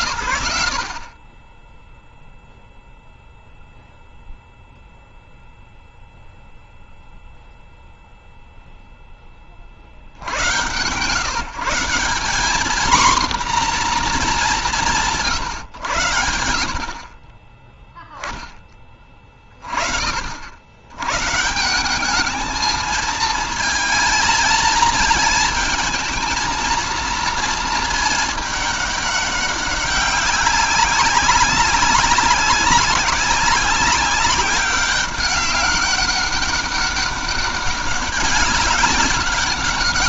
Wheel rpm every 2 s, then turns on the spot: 20, 0, 0, 0, 40, 150, 240, 120, 10, 40, 190, 230, 230, 230, 200, 190, 190, 200, 200, 200.
none